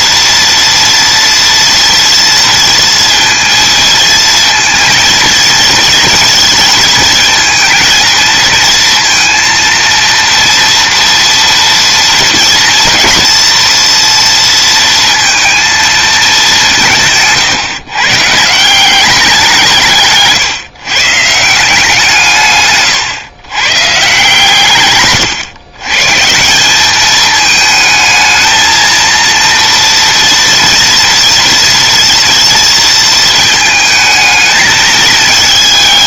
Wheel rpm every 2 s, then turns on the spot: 230, 230, 230, 220, 230, 230, 230, 230, 170, 190, 150, 130, 120, 210, 230, 230, 230, 220.
24-26